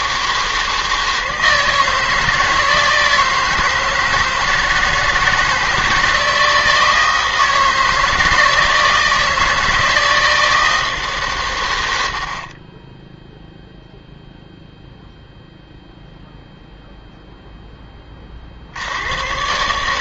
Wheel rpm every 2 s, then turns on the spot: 160, 160, 160, 160, 160, 160, 10, 0, 0, 70.
none